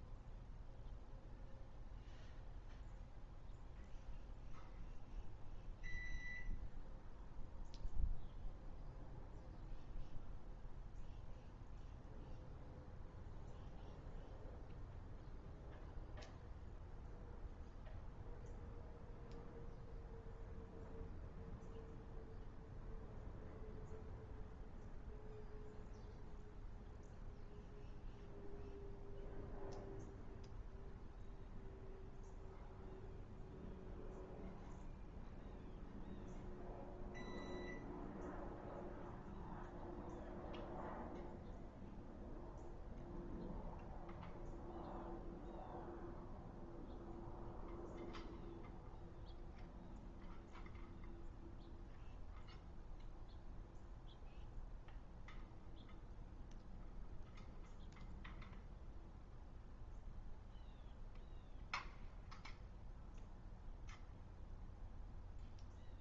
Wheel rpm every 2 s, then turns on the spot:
0, 0, 0, 0, 0, 0, 0, 0, 0, 0, 0, 0, 0, 0, 0, 0, 0, 0, 0, 0, 0, 0, 0, 0, 0, 0, 0, 0, 0, 0, 0, 0, 0.
none